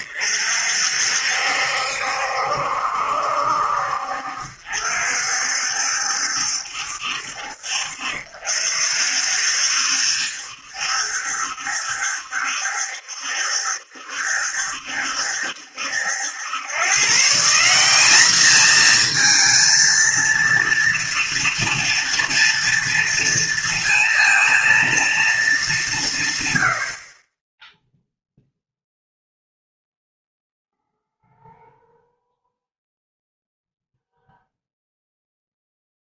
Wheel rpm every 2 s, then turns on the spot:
60, 70, 60, 70, 60, 70, 70, 70, 100, 220, 230, 230, 230, 120, 0, 0, 0, 0.
none